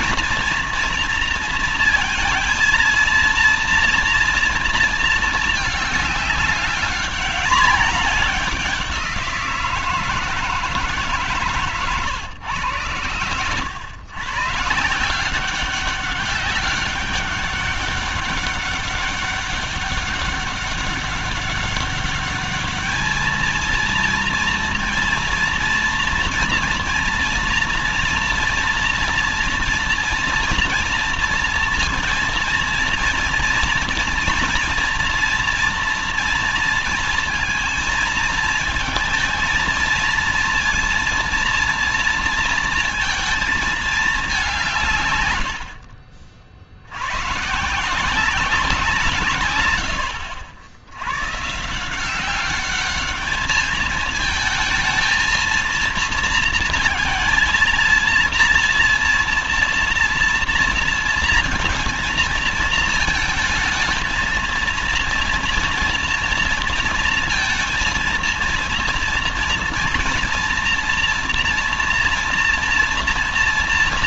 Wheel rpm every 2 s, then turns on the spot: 230, 230, 230, 200, 190, 160, 110, 130, 190, 200, 200, 210, 230, 230, 230, 230, 230, 240, 230, 220, 230, 230, 160, 50, 180, 90, 200, 220, 230, 230, 230, 220, 220, 230, 230, 240, 230.
none